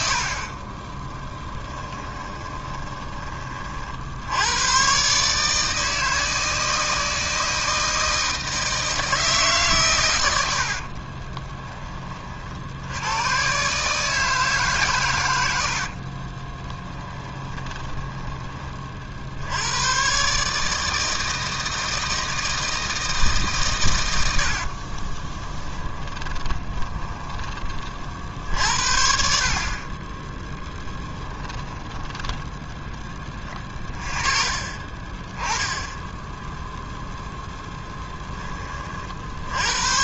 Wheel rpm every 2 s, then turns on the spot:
30, 20, 130, 160, 160, 30, 90, 120, 10, 40, 160, 160, 30, 20, 60, 10, 20, 30, 0, 30.
10-12 16-18 24-28 30-32